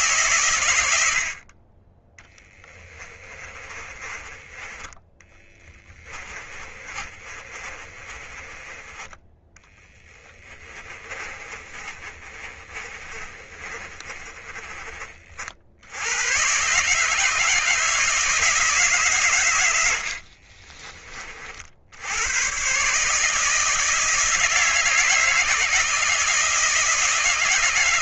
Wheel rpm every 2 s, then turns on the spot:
100, 20, 10, 30, 20, 30, 30, 30, 140, 150, 30, 140, 160, 160.
2-8 10-14